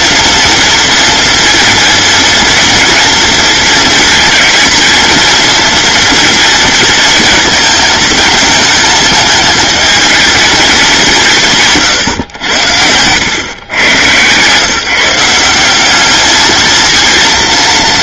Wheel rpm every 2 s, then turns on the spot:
230, 230, 230, 230, 220, 210, 90, 150, 230.
none